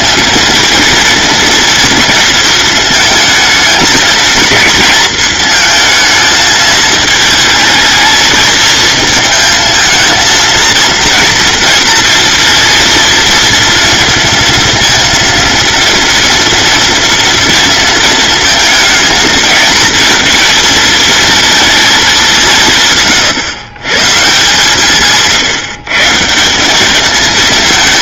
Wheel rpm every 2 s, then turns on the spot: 230, 220, 220, 220, 220, 230, 230, 230, 230, 230, 230, 130, 150, 200.
none